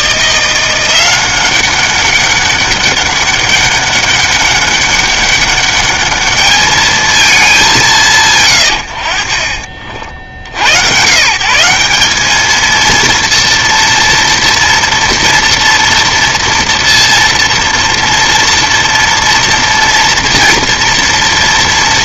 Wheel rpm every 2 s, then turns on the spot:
170, 200, 200, 210, 110, 80, 220, 230, 230, 230, 230.
none